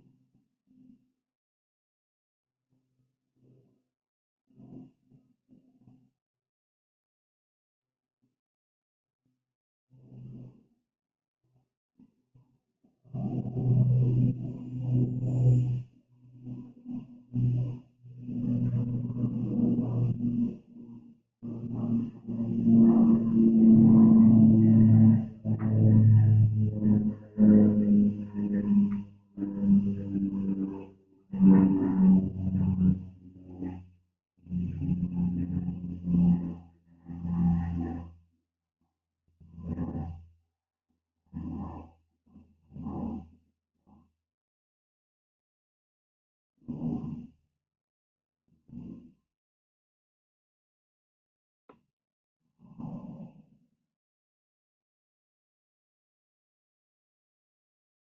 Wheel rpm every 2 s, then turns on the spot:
0, 0, 0, 0, 0, 0, 0, 0, 0, 0, 0, 0, 0, 0, 0, 0, 0, 0, 0, 0, 0, 0, 0, 0, 0, 0, 0, 0, 0.
none